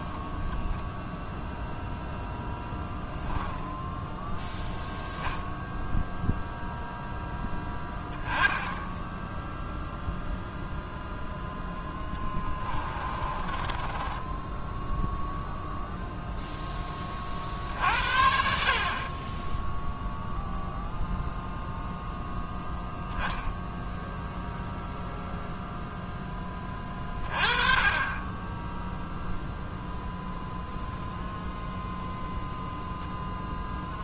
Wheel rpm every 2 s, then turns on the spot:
0, 10, 0, 0, 10, 0, 20, 10, 10, 50, 0, 0, 0, 20, 10, 0, 0.
12-16